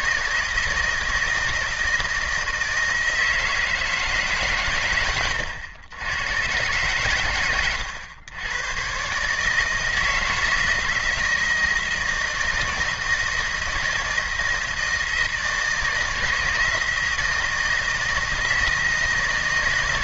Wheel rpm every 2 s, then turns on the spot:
160, 160, 120, 120, 120, 170, 160, 160, 160, 160.
none